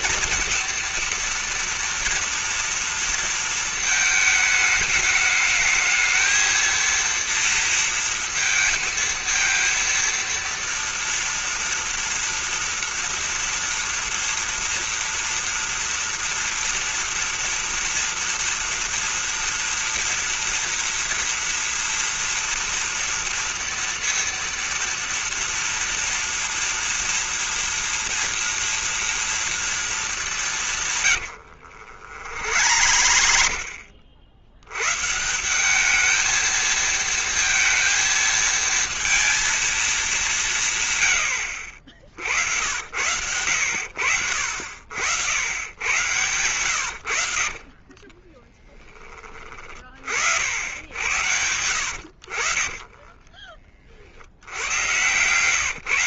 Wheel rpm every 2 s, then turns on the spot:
230, 230, 210, 230, 220, 230, 230, 230, 230, 230, 230, 230, 230, 230, 230, 160, 70, 110, 220, 230, 140, 90, 70, 90, 20, 90, 40, 100.
30-34 46-48 52-54